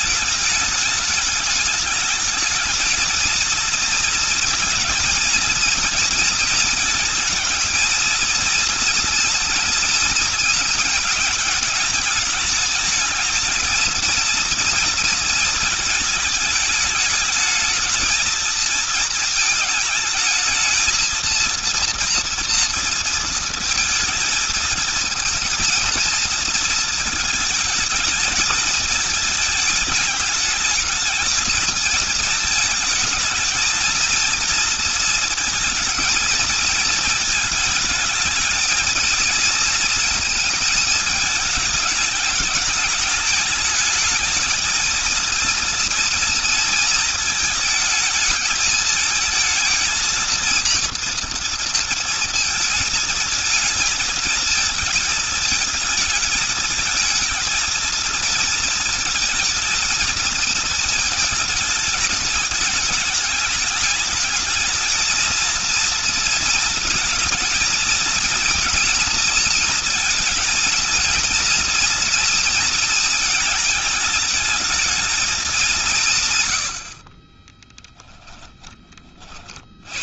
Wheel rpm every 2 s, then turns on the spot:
210, 230, 230, 220, 230, 220, 220, 220, 210, 220, 230, 230, 230, 220, 220, 220, 220, 230, 220, 220, 220, 210, 230, 220, 220, 230, 220, 220, 220, 220, 220, 210, 220, 230, 230, 230, 220, 220, 60, 20.
76-78